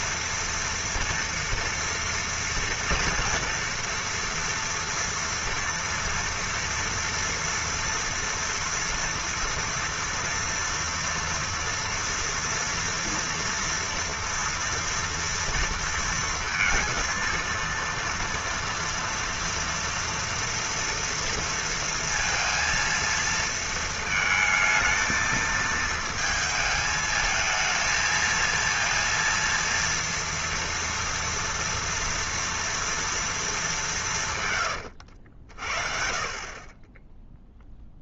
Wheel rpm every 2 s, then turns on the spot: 230, 230, 230, 230, 230, 230, 230, 230, 230, 230, 230, 230, 220, 220, 230, 230, 230, 90, 20.
34-36